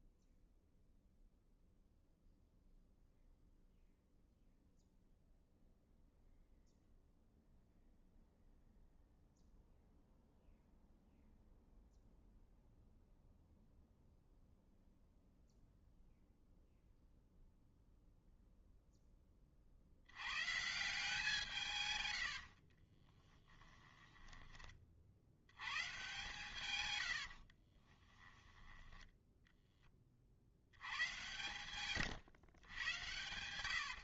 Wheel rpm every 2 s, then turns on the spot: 0, 0, 0, 0, 0, 0, 0, 0, 0, 0, 150, 50, 20, 130, 10, 80, 110.
22-24